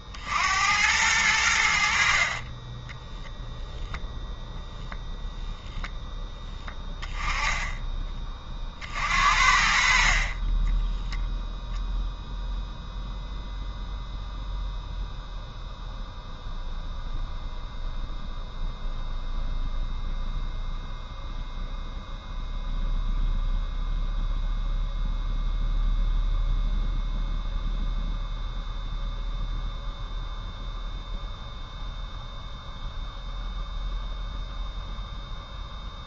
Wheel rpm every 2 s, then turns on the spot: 90, 0, 0, 10, 60, 10, 0, 0, 0, 0, 0, 0, 0, 0, 0, 0, 0, 0.
6-8